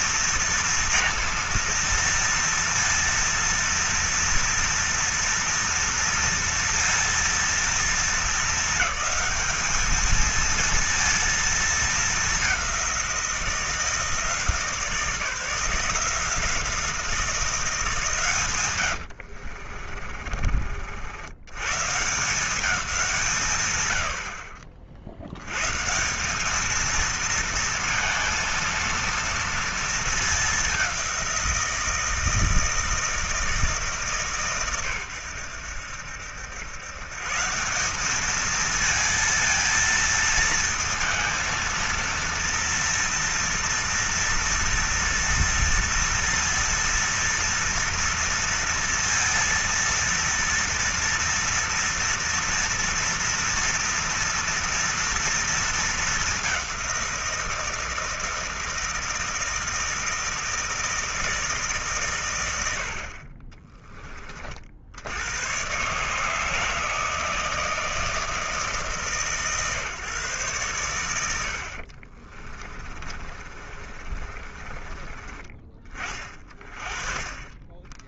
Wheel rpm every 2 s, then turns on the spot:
230, 230, 230, 230, 220, 230, 180, 160, 170, 90, 80, 180, 60, 220, 230, 190, 160, 110, 120, 230, 230, 230, 230, 230, 230, 230, 230, 230, 180, 160, 160, 70, 80, 160, 150, 110, 30, 30, 30.
18-20 72-74